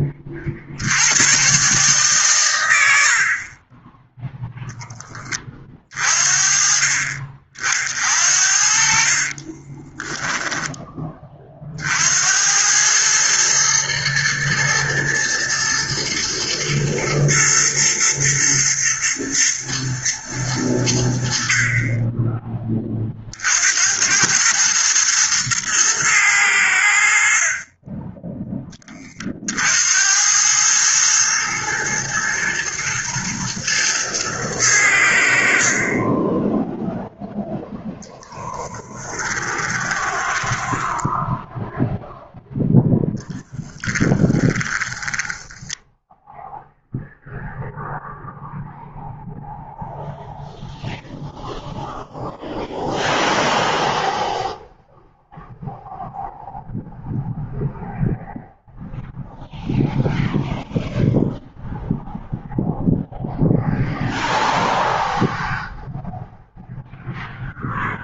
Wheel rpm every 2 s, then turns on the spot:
80, 80, 10, 40, 50, 20, 100, 110, 120, 110, 90, 40, 110, 80, 20, 110, 110, 90, 0, 10, 10, 0, 10, 0, 0, 0, 0, 0, 0, 0, 0, 0, 0, 0.
8-10 38-42 44-46